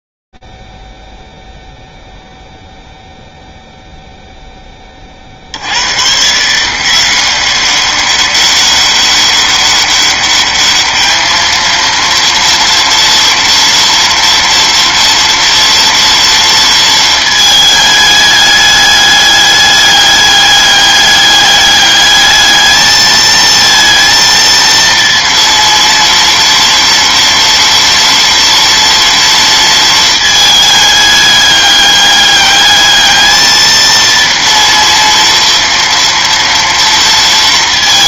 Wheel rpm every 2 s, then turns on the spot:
0, 0, 0, 120, 200, 200, 230, 230, 230, 210, 210, 210, 230, 230, 230, 220, 200, 230, 230.
none